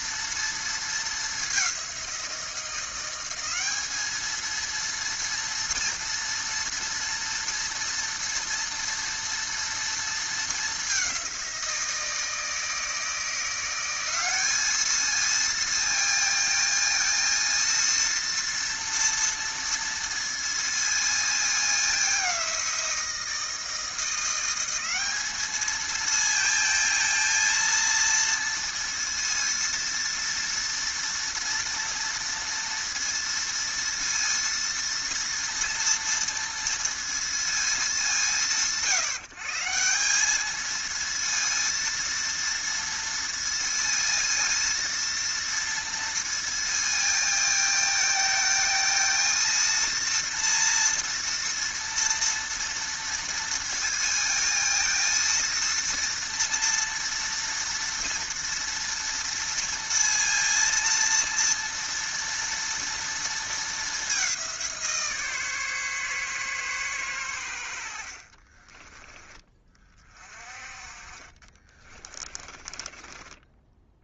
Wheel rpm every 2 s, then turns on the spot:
230, 180, 220, 230, 230, 220, 160, 210, 230, 230, 230, 180, 180, 220, 230, 230, 230, 230, 230, 150, 210, 230, 230, 230, 220, 230, 230, 230, 230, 230, 230, 230, 180, 130, 40, 30, 30.
68-70 72-74